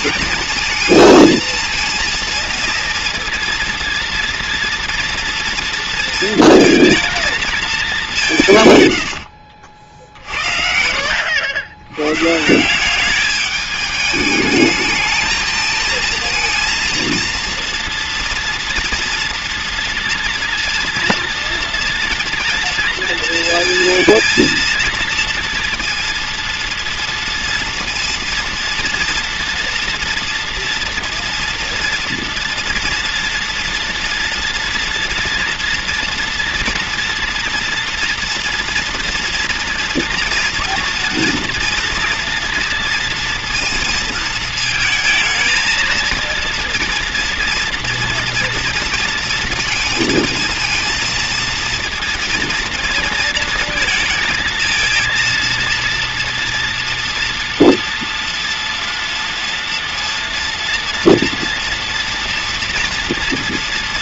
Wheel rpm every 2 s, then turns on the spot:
220, 230, 230, 230, 120, 60, 180, 220, 230, 230, 230, 230, 230, 230, 230, 240, 230, 230, 230, 240, 230, 240, 220, 230, 230, 230, 230, 230, 230, 240, 230, 240.
8-10